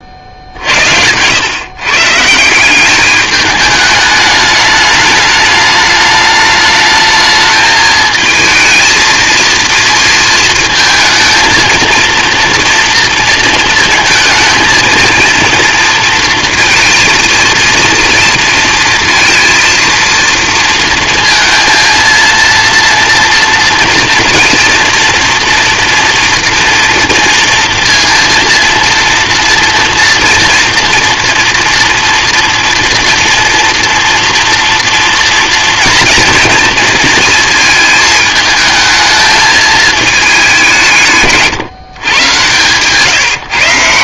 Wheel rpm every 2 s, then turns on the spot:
70, 180, 210, 210, 220, 220, 230, 230, 230, 230, 230, 230, 240, 230, 230, 240, 230, 240, 230, 220, 170, 130.
none